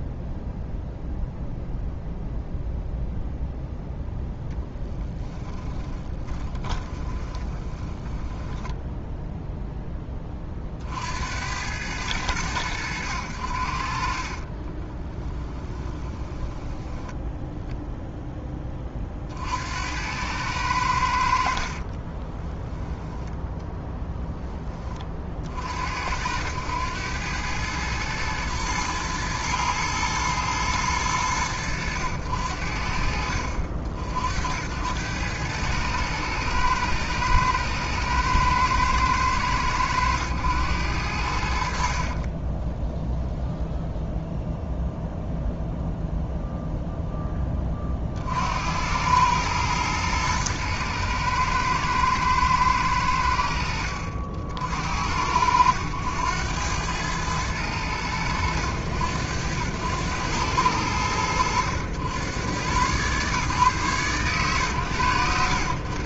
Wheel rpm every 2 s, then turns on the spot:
0, 0, 10, 20, 0, 60, 90, 20, 10, 20, 80, 10, 40, 100, 110, 110, 60, 90, 110, 110, 90, 10, 0, 0, 80, 110, 80, 70, 100, 90, 90, 120, 100.
4-8 14-16 22-24